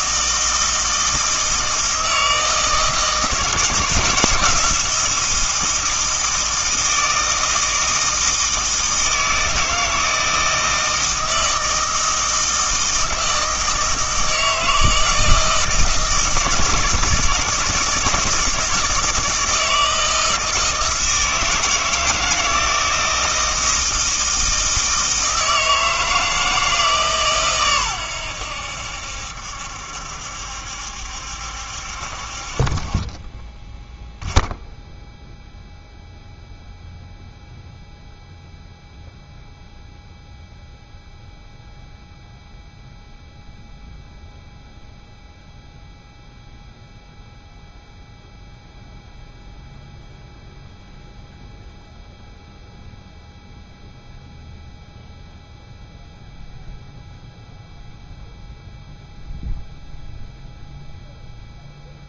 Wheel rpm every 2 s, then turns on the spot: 160, 160, 170, 160, 160, 160, 160, 160, 160, 160, 160, 160, 160, 160, 80, 70, 30, 0, 0, 0, 0, 0, 0, 0, 0, 0, 0, 0, 0, 0, 0.
none